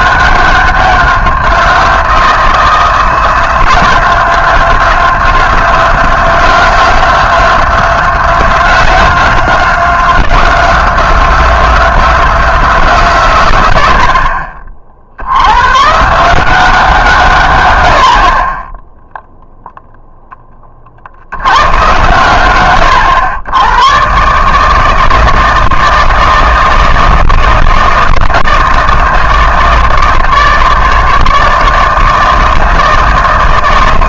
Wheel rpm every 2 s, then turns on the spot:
190, 170, 180, 180, 180, 180, 170, 40, 180, 20, 30, 110, 150, 160, 160, 160, 160.
none